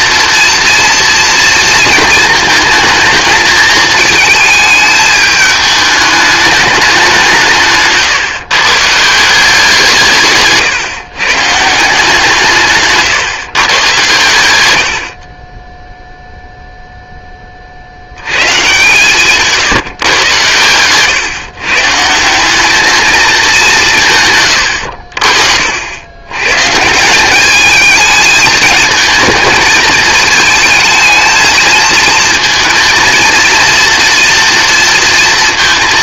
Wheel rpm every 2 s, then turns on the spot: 240, 230, 220, 200, 140, 140, 150, 90, 0, 140, 120, 200, 90, 140, 220, 220, 230, 230.
none